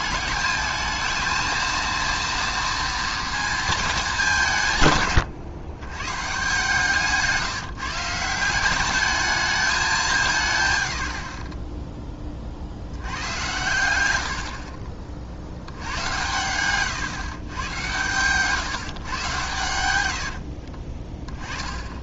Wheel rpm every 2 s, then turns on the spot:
220, 230, 150, 150, 170, 130, 60, 50, 110, 130, 30.
20-22